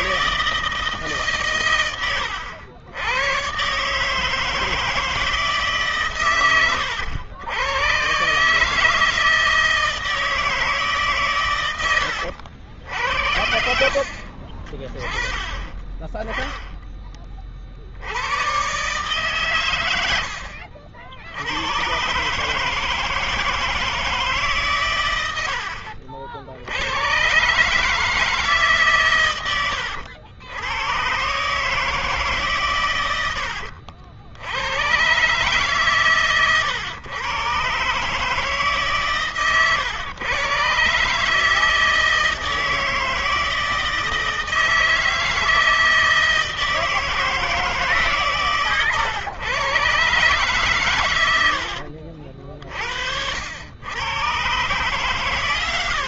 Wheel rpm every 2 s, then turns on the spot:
160, 90, 160, 120, 140, 160, 90, 40, 10, 110, 80, 140, 150, 60, 150, 90, 140, 100, 120, 150, 120, 160, 160, 160, 140, 130, 50, 120.
none